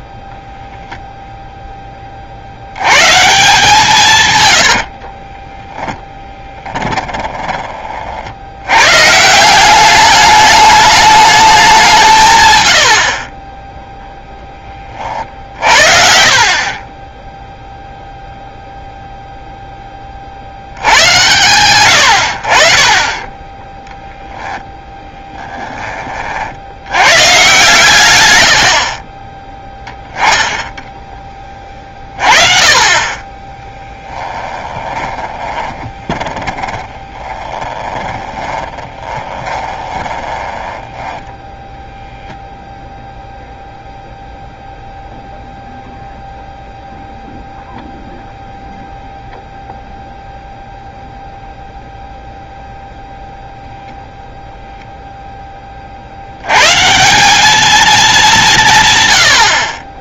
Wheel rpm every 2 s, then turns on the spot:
0, 100, 80, 20, 110, 210, 100, 20, 30, 0, 80, 40, 10, 90, 70, 10, 30, 10, 30, 20, 10, 0, 0, 0, 0, 0, 0, 0, 130, 150.
4-8 28-30 34-42